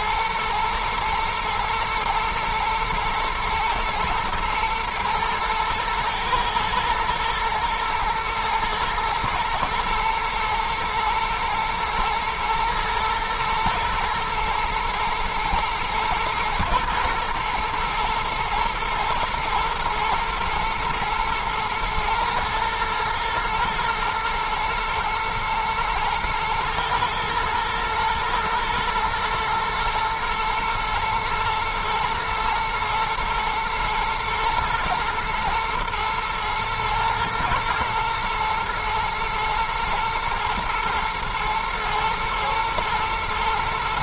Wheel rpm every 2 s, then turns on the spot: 110, 110, 120, 110, 110, 110, 120, 110, 110, 120, 120, 120, 120, 110, 110, 110, 120, 120, 110, 120, 110, 110.
none